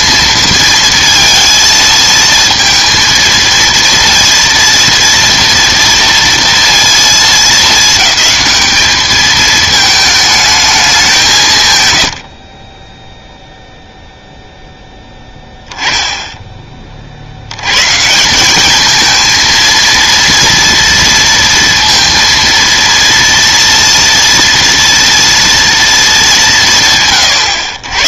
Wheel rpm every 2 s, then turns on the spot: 230, 230, 230, 230, 210, 220, 40, 0, 20, 200, 230, 230, 230, 170.
none